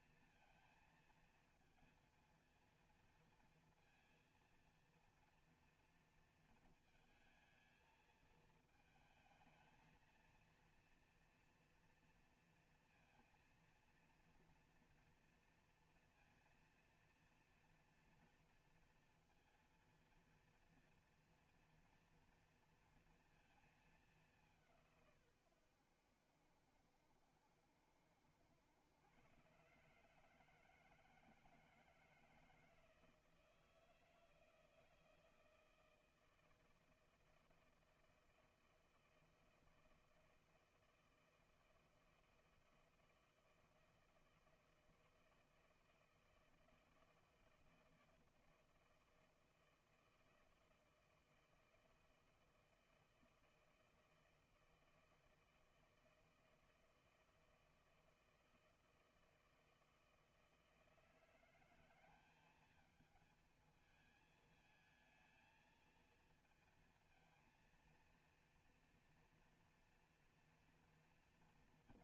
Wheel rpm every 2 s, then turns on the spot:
230, 230, 230, 230, 220, 230, 230, 230, 230, 230, 230, 240, 190, 80, 80, 150, 160, 160, 160, 160, 160, 160, 160, 160, 160, 160, 160, 160, 160, 160, 160, 200, 220, 230, 230, 240.
none